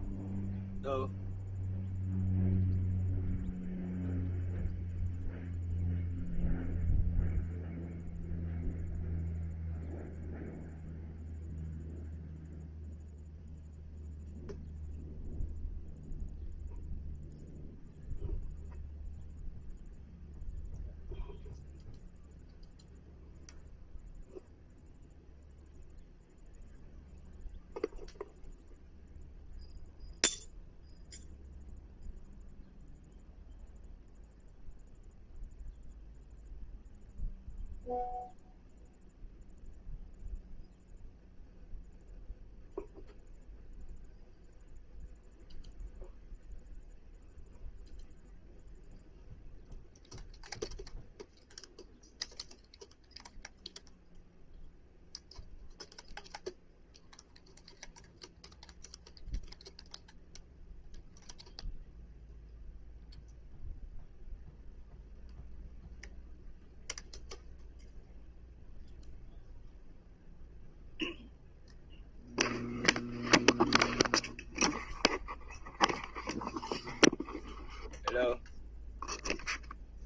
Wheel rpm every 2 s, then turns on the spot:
0, 0, 0, 0, 0, 0, 0, 0, 0, 0, 0, 0, 0, 0, 0, 0, 0, 0, 0, 0, 0, 0, 0, 0, 0, 0, 0, 0, 0, 0, 0, 0, 0, 0, 0, 0, 0, 0, 0, 0.
none